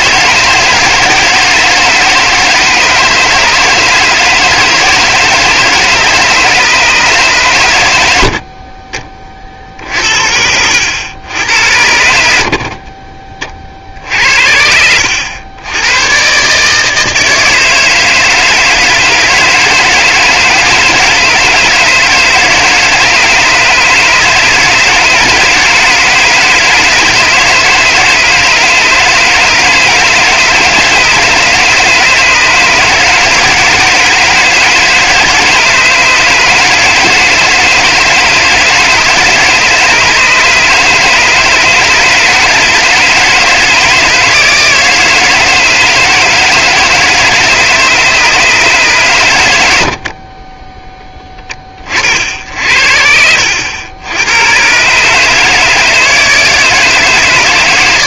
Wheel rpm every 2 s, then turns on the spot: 160, 160, 160, 150, 50, 80, 50, 80, 150, 160, 160, 160, 160, 160, 160, 160, 150, 160, 160, 160, 150, 160, 160, 160, 140, 20, 60, 110, 160.
50-52